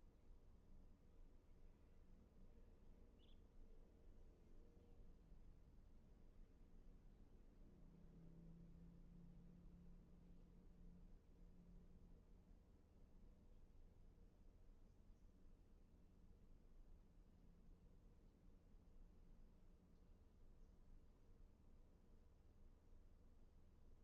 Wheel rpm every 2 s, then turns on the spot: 0, 0, 0, 0, 0, 0, 0, 0, 0, 0, 0, 0.
none